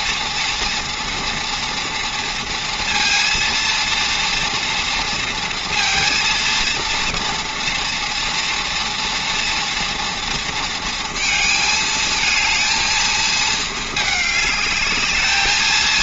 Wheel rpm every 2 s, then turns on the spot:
230, 230, 230, 230, 230, 230, 230, 210.
none